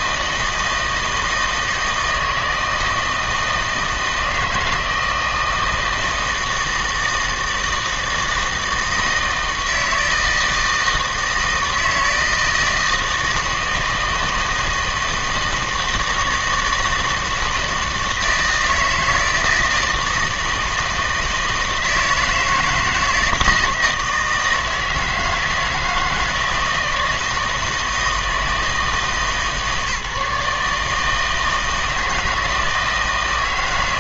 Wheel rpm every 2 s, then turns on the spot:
160, 160, 160, 160, 160, 160, 160, 160, 160, 160, 160, 160, 160, 160, 160, 150, 160.
none